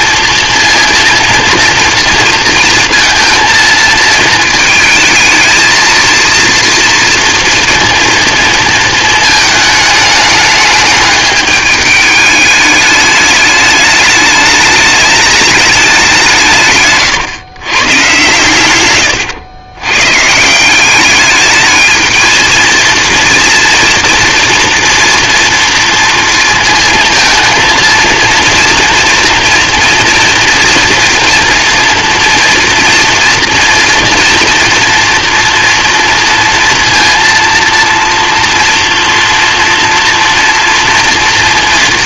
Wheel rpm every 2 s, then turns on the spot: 230, 230, 220, 230, 230, 210, 210, 210, 130, 120, 180, 230, 230, 230, 230, 230, 230, 230, 230, 230, 240.
none